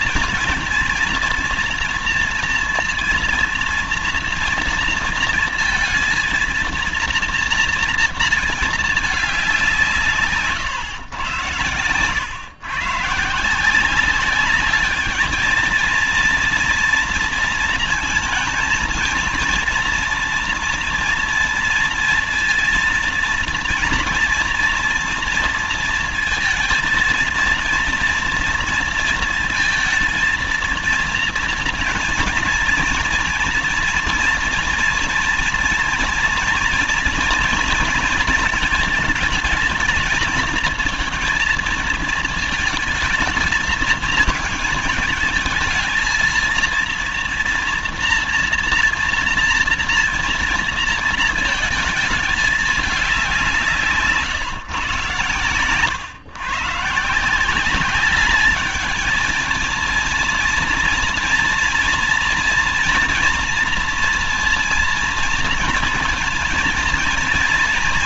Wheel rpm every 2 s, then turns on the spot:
230, 230, 230, 230, 220, 150, 120, 200, 230, 230, 240, 230, 230, 230, 230, 220, 230, 230, 230, 220, 230, 220, 220, 230, 230, 230, 210, 140, 140, 210, 230, 230, 230, 230.
none